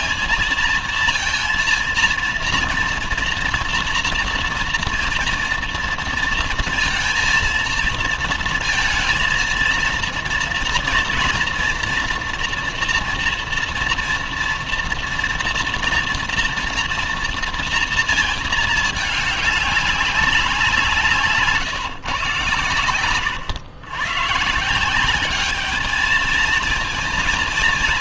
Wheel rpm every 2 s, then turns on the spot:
230, 240, 230, 230, 230, 230, 240, 230, 230, 210, 170, 120, 150, 220.
22-24